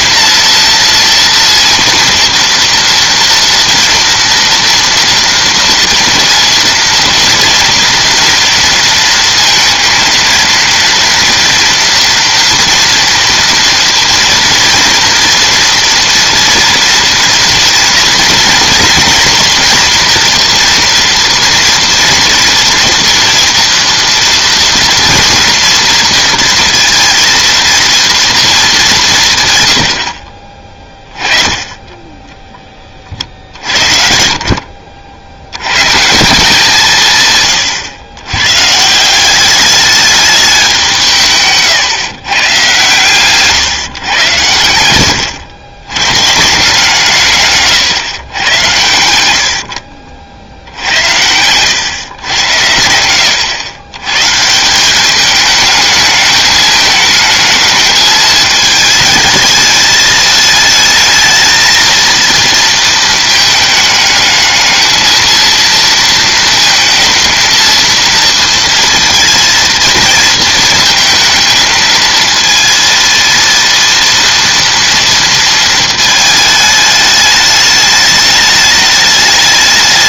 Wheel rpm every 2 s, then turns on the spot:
230, 230, 230, 230, 230, 230, 230, 230, 240, 230, 230, 230, 230, 230, 220, 30, 20, 50, 180, 120, 190, 130, 90, 160, 100, 80, 90, 160, 210, 210, 220, 230, 210, 230, 230, 220, 230, 230, 220, 210.
none